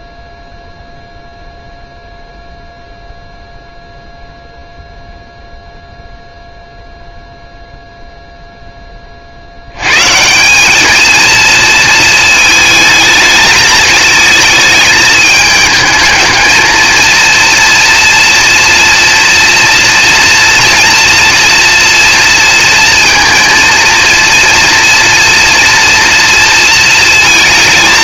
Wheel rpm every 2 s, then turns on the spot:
0, 0, 0, 0, 80, 220, 210, 220, 230, 230, 230, 230, 230, 230.
none